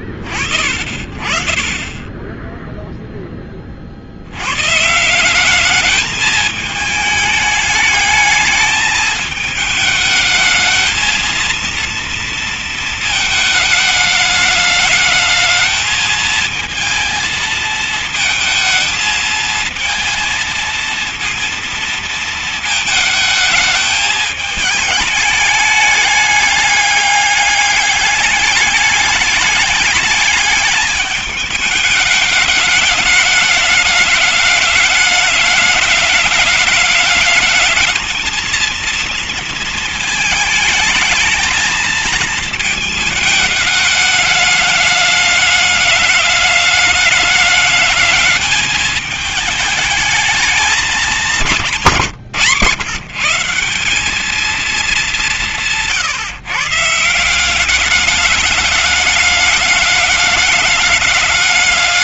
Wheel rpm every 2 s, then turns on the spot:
50, 20, 90, 220, 220, 220, 230, 210, 220, 220, 220, 230, 220, 200, 200, 210, 220, 210, 210, 220, 220, 220, 210, 210, 210, 210, 130, 210, 150, 200, 210.
none